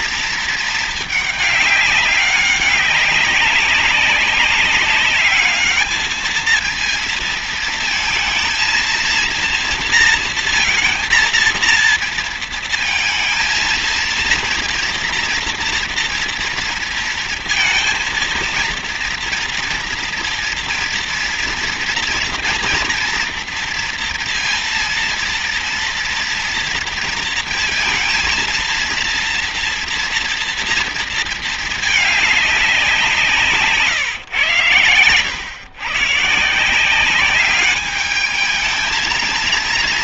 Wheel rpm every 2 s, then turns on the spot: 220, 200, 200, 230, 230, 230, 230, 230, 230, 230, 230, 230, 230, 230, 230, 230, 180, 110, 180, 220.
none